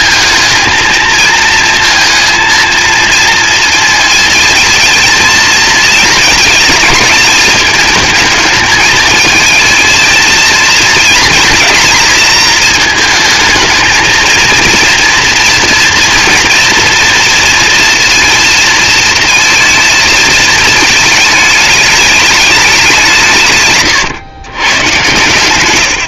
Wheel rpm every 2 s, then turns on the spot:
220, 230, 230, 220, 220, 230, 220, 230, 240, 230, 220, 190, 120.
none